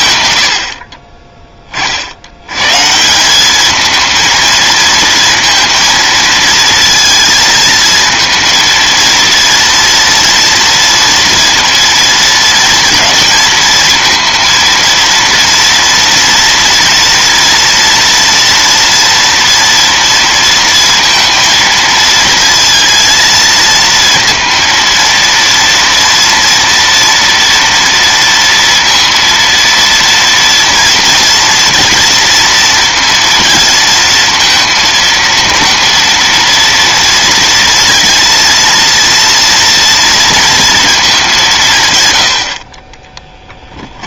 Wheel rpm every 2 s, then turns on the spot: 40, 220, 230, 220, 230, 230, 230, 230, 230, 230, 230, 220, 230, 230, 230, 230, 230, 230, 230, 230, 140, 40.
none